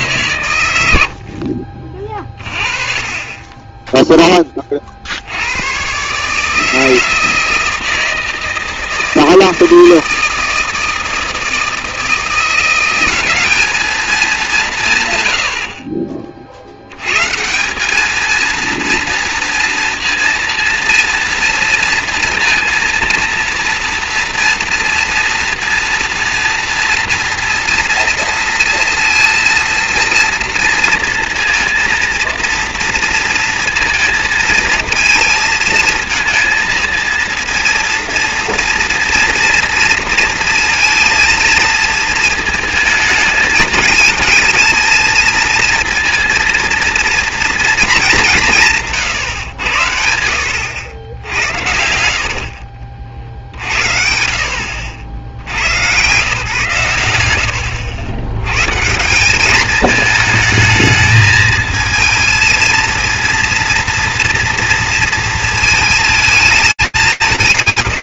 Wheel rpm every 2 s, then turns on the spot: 70, 30, 50, 160, 160, 160, 190, 110, 120, 230, 230, 230, 230, 230, 230, 230, 230, 230, 230, 240, 230, 220, 220, 230, 140, 80, 50, 70, 100, 170, 220, 230, 230, 190.
50-52